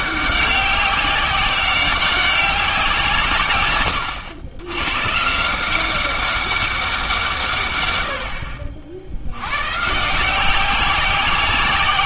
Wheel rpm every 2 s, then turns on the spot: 190, 180, 110, 190, 60, 190.
none